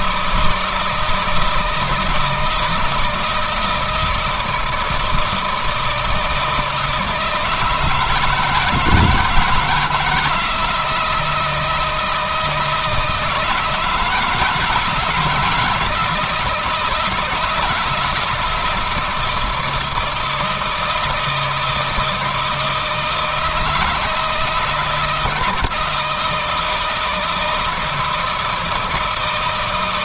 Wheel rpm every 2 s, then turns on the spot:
160, 160, 160, 160, 160, 160, 160, 170, 160, 160, 160, 160, 160, 160, 160.
none